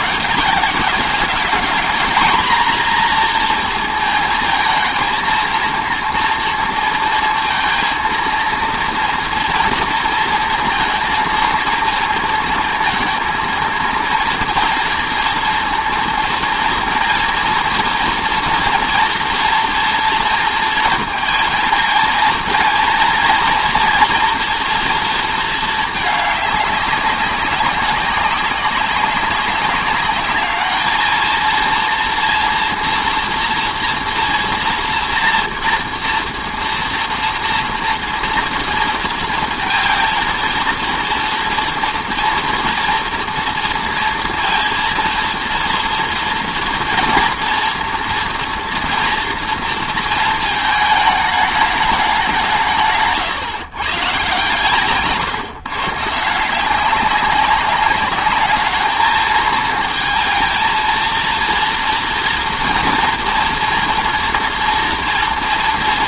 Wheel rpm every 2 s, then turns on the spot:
200, 230, 220, 230, 230, 230, 230, 230, 230, 230, 230, 230, 230, 210, 190, 210, 230, 240, 230, 230, 230, 240, 230, 230, 240, 220, 160, 150, 180, 210, 230, 230, 230.
none